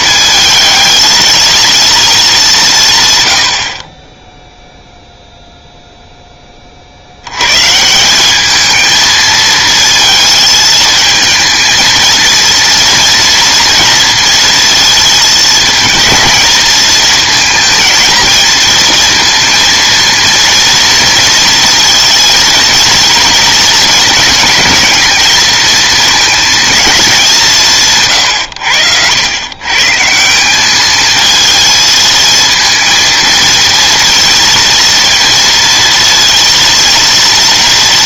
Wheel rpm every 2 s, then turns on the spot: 220, 170, 0, 30, 220, 220, 230, 230, 220, 230, 230, 230, 220, 220, 90, 200, 230, 230, 230.
none